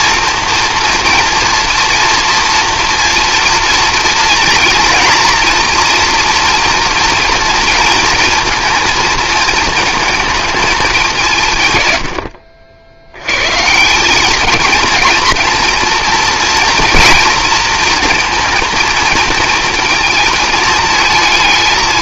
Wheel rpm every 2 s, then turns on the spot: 230, 230, 230, 230, 230, 210, 70, 210, 230, 220, 220.
none